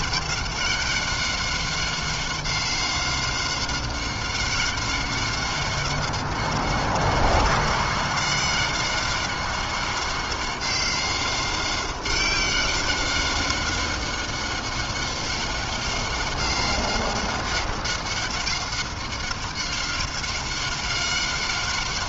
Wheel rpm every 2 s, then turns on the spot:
190, 190, 190, 190, 190, 190, 190, 190, 190, 190, 190.
none